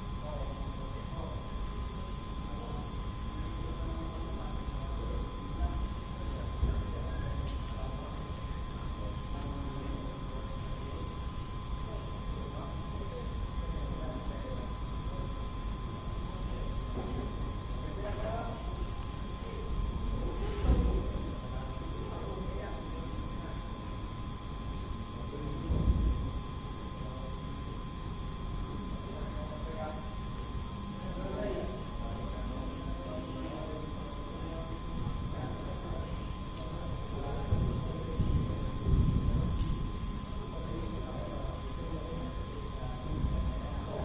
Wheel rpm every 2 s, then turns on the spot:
0, 0, 0, 0, 0, 0, 0, 0, 0, 0, 0, 0, 0, 0, 0, 0, 0, 0, 0, 0, 0, 0.
none